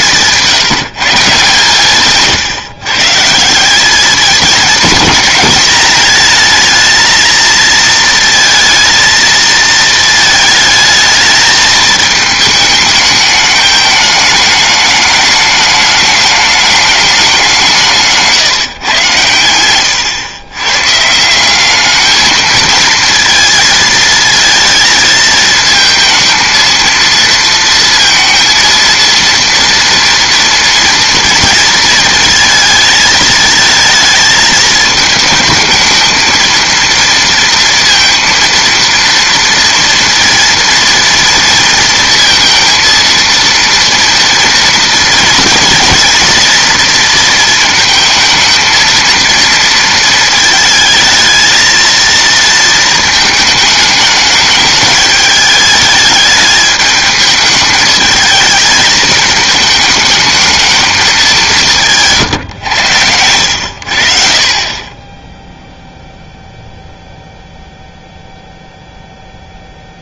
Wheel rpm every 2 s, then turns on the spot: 150, 140, 210, 220, 230, 220, 220, 210, 210, 140, 120, 220, 230, 220, 230, 230, 230, 220, 230, 230, 230, 230, 230, 230, 230, 220, 220, 210, 210, 220, 220, 120, 30, 0, 0.
none